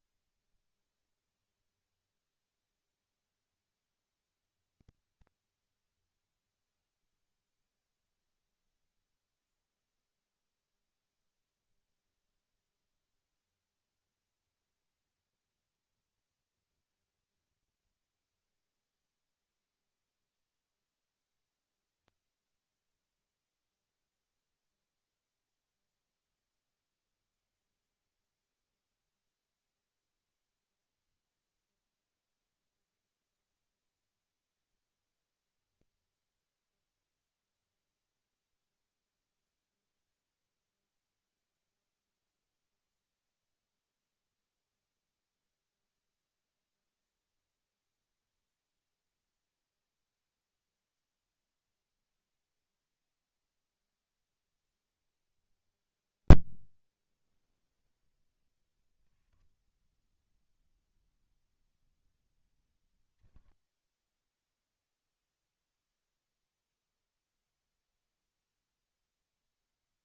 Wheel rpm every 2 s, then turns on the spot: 30, 50, 60, 60, 50, 10, 80, 110, 110, 40, 0, 0, 0, 20, 20, 10, 10, 10, 20, 10, 0, 10, 10, 10, 20, 0, 10, 30, 10, 0, 0, 0, 0, 0, 0.
18-20 28-38